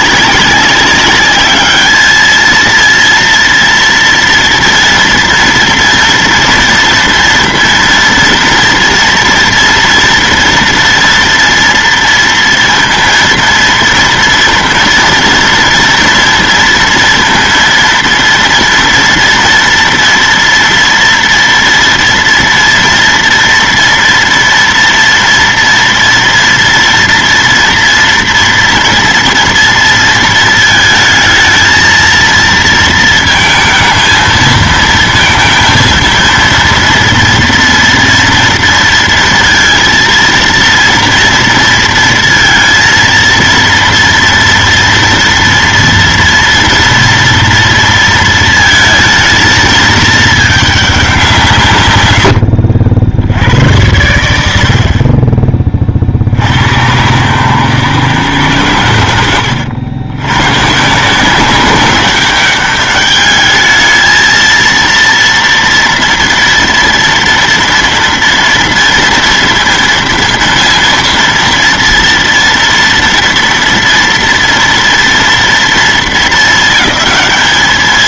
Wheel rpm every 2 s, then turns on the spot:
200, 230, 230, 240, 230, 230, 230, 230, 230, 230, 230, 230, 230, 230, 240, 230, 230, 230, 240, 230, 230, 230, 230, 230, 230, 210, 60, 70, 90, 110, 130, 200, 230, 230, 230, 230, 230, 230, 220.
none